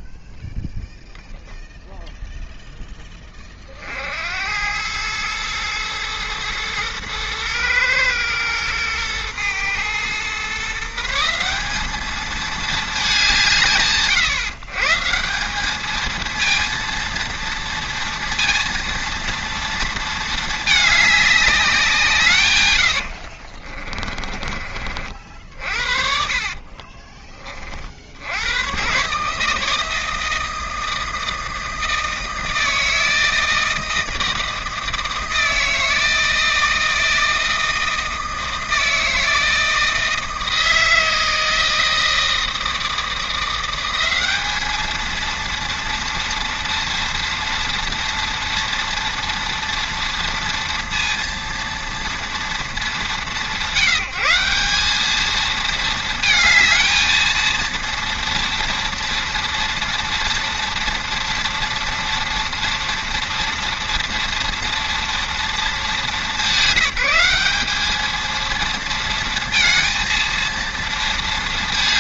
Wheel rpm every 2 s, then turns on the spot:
10, 10, 100, 110, 110, 150, 210, 150, 230, 230, 210, 100, 40, 30, 110, 160, 160, 160, 160, 160, 160, 160, 210, 230, 230, 230, 190, 190, 220, 230, 230, 230, 230, 190, 230, 230.
22-24 26-28